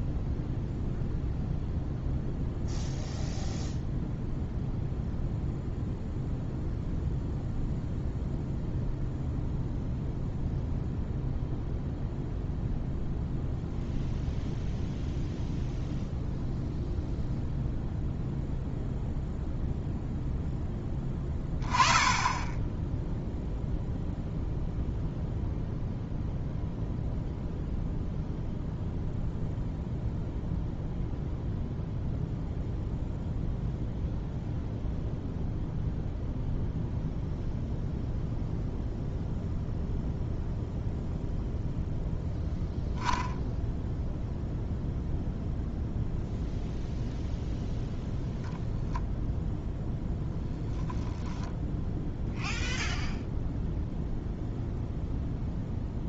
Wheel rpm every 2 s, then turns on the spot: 0, 0, 0, 0, 0, 0, 0, 0, 0, 0, 10, 10, 0, 0, 0, 0, 0, 0, 0, 0, 0, 0, 0, 0, 0, 0, 0, 0.
none